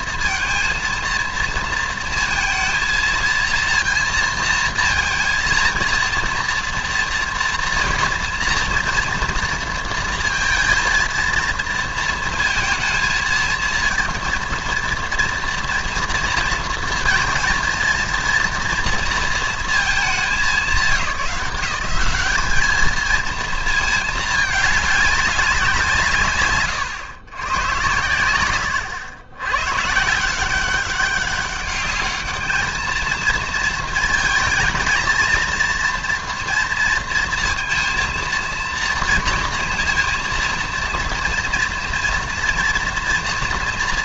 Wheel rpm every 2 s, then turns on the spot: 230, 230, 230, 230, 230, 230, 230, 230, 230, 230, 200, 210, 210, 130, 100, 190, 220, 220, 230, 230, 230, 230.
none